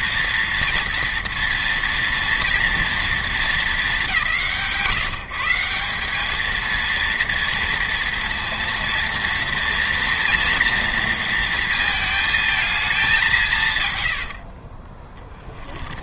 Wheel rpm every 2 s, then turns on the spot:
230, 230, 150, 230, 230, 230, 200, 20.
14-16